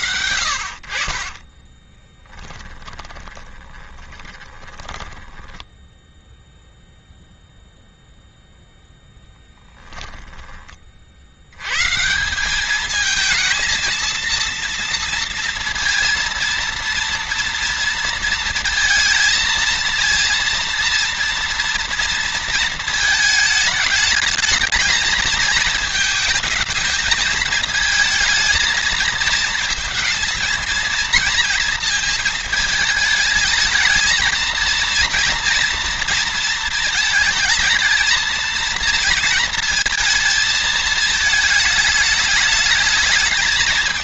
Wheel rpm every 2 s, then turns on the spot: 50, 10, 10, 0, 10, 50, 220, 230, 230, 230, 230, 220, 220, 220, 220, 230, 220, 230, 230, 230, 220, 210.
0-6 8-10